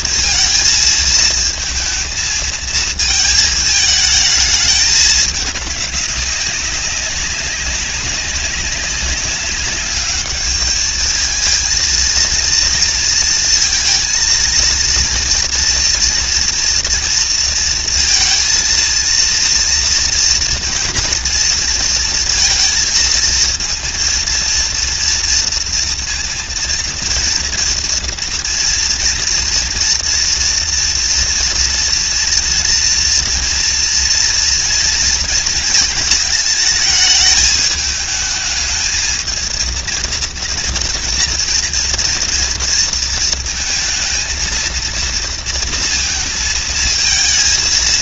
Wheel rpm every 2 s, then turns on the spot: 230, 220, 210, 190, 200, 220, 230, 230, 230, 230, 230, 230, 230, 230, 230, 230, 230, 230, 220, 220, 230, 230, 230, 230.
none